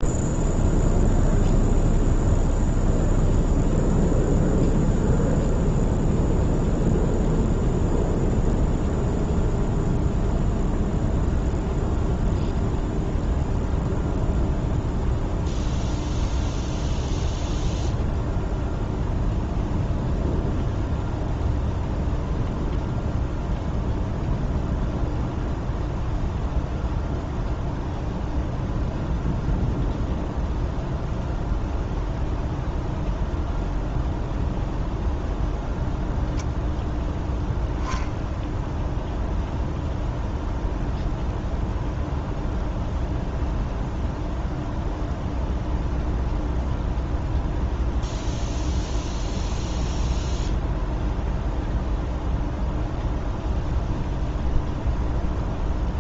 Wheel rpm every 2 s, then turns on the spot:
0, 0, 0, 0, 0, 0, 0, 0, 0, 0, 0, 0, 0, 0, 0, 0, 0, 0, 0, 0, 0, 0, 0, 0, 0, 0, 0, 0.
none